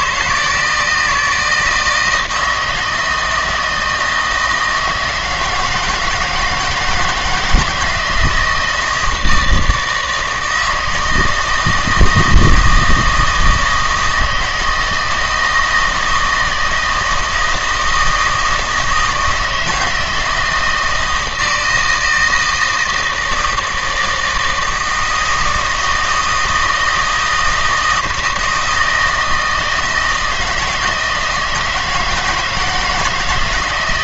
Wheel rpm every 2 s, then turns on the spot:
160, 160, 160, 160, 160, 160, 160, 160, 160, 160, 160, 160, 160, 160, 160, 170, 160.
none